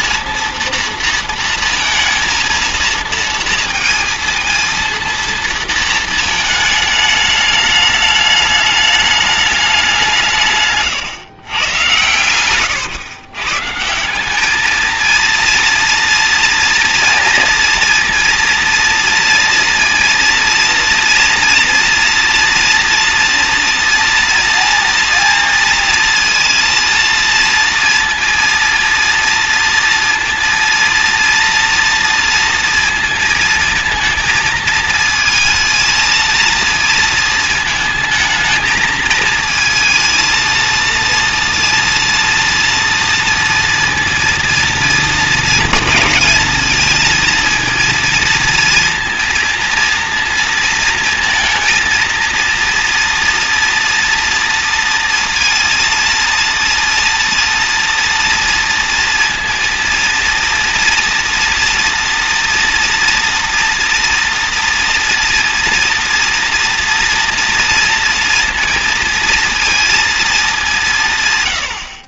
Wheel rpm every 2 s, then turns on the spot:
230, 230, 230, 210, 210, 130, 120, 220, 230, 230, 230, 230, 230, 230, 230, 230, 230, 220, 230, 220, 230, 230, 230, 230, 230, 230, 230, 230, 230, 230, 230, 230, 230, 230, 230, 140.
none